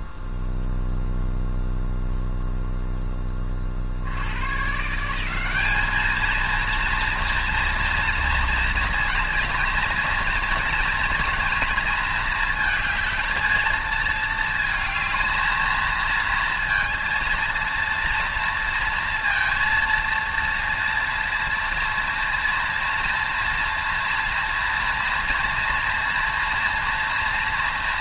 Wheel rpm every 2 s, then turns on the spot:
0, 0, 150, 230, 230, 220, 220, 220, 230, 230, 230, 240, 230, 230.
none